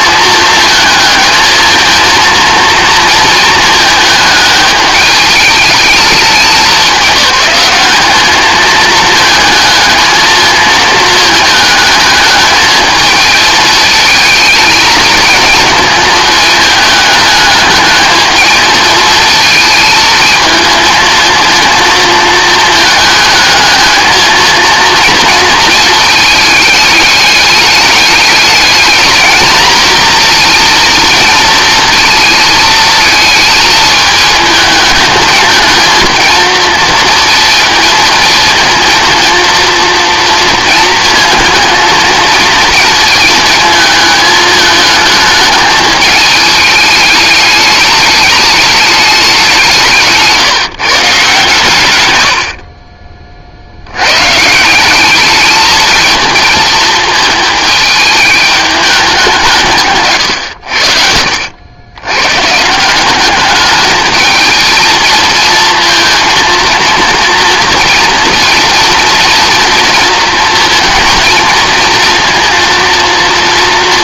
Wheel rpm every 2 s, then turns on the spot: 220, 230, 210, 200, 220, 220, 220, 220, 220, 220, 230, 220, 230, 220, 210, 230, 220, 220, 230, 220, 220, 230, 220, 210, 210, 160, 60, 160, 220, 210, 100, 130, 220, 230, 230, 230, 230.
none